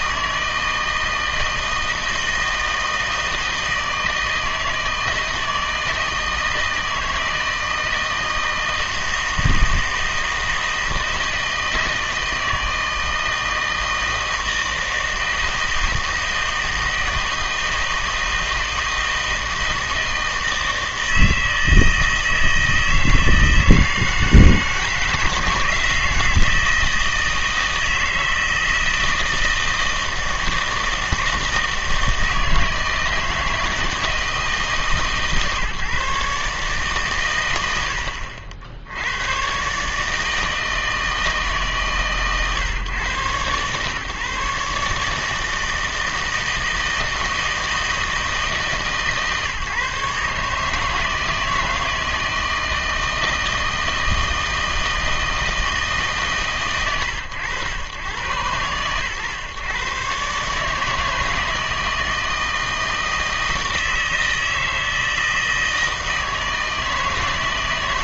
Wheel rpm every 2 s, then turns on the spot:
160, 160, 160, 160, 160, 160, 160, 160, 160, 160, 160, 160, 160, 160, 160, 160, 160, 150, 140, 70, 160, 130, 150, 160, 150, 160, 160, 160, 130, 110, 150, 160, 160, 160.
none